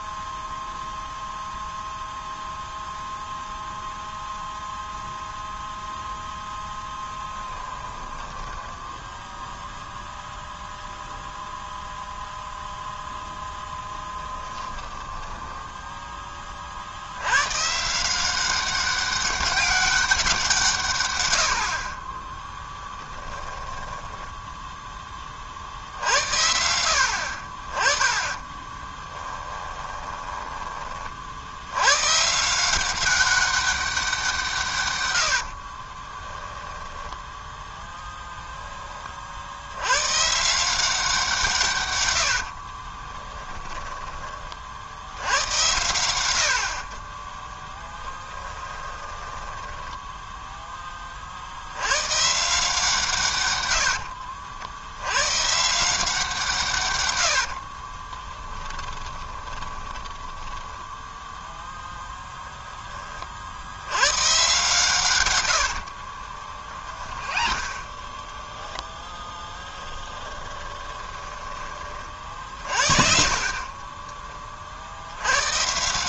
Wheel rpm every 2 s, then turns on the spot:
0, 0, 0, 10, 10, 0, 0, 10, 60, 190, 130, 20, 10, 70, 10, 30, 190, 120, 10, 20, 170, 20, 70, 40, 20, 20, 150, 90, 120, 20, 10, 30, 120, 40, 10, 20, 40, 70.
6-10 14-16 22-24 28-30 42-44 48-50 58-60 66-68 70-72